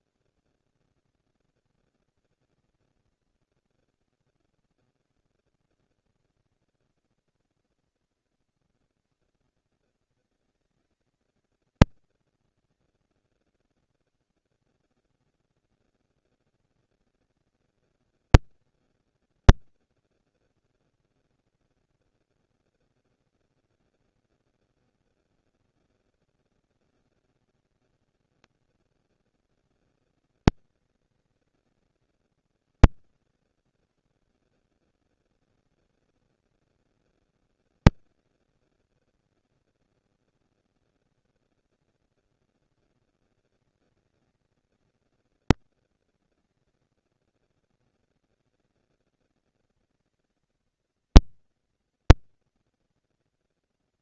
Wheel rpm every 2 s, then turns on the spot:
130, 220, 50, 170, 90, 210, 230, 180, 230, 230, 240, 230, 230, 230, 230, 200, 140, 150, 220, 230, 240, 230, 220, 230, 230, 220, 230.
none